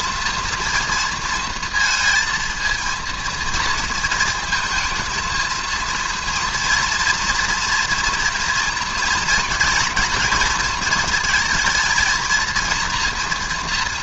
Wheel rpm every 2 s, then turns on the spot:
230, 230, 220, 230, 230, 230, 230.
none